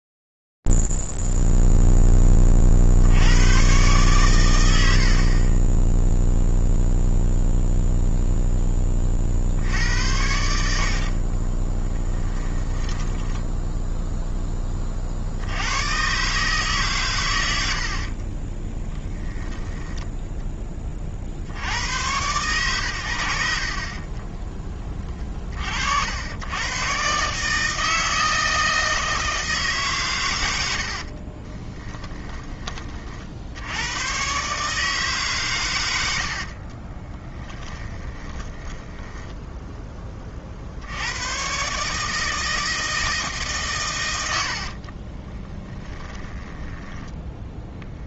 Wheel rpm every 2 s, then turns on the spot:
0, 10, 120, 0, 0, 80, 20, 10, 140, 20, 20, 120, 20, 120, 160, 70, 30, 150, 30, 10, 80, 160, 40, 10.
12-14 18-20 30-32 36-40 44-48